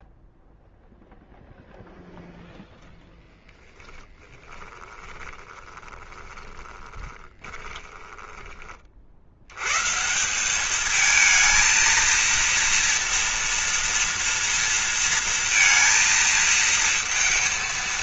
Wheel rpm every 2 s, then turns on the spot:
0, 0, 20, 20, 20, 180, 230, 230, 230.
4-8